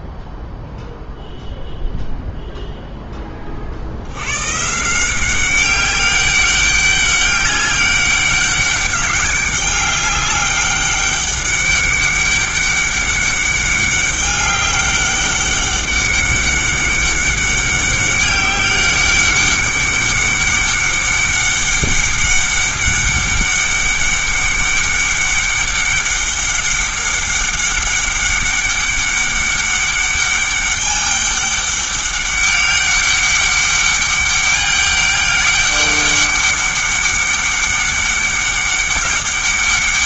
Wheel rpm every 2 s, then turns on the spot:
0, 0, 150, 200, 200, 200, 200, 200, 200, 200, 200, 200, 200, 200, 200, 200, 200, 200, 200, 200.
none